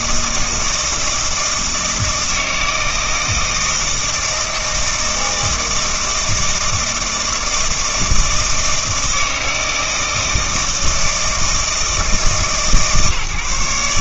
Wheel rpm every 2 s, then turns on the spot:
160, 160, 160, 160, 160, 160, 150.
none